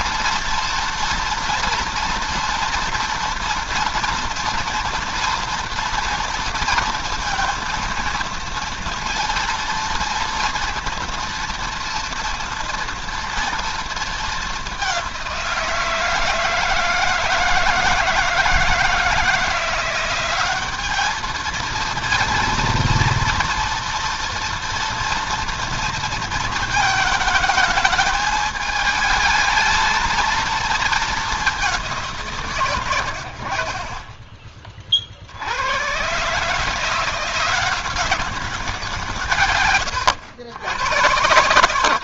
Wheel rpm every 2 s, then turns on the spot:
240, 230, 230, 230, 230, 230, 230, 190, 160, 160, 200, 230, 230, 220, 220, 220, 120, 50, 170, 170, 110.
none